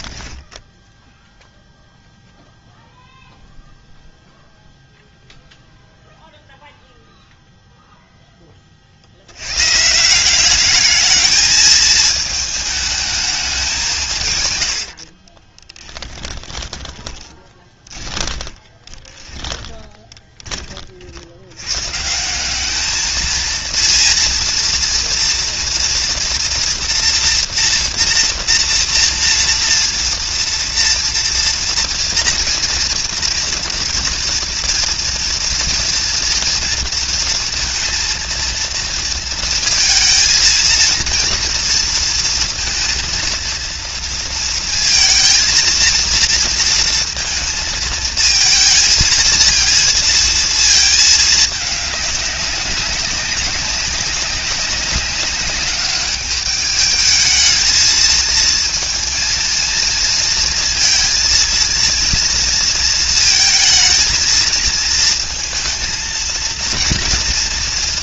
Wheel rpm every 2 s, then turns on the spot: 10, 0, 0, 0, 40, 210, 220, 80, 10, 20, 40, 210, 230, 240, 240, 230, 230, 230, 230, 230, 230, 230, 220, 230, 230, 220, 190, 190, 210, 230, 230, 230, 230, 230.
0-2 16-20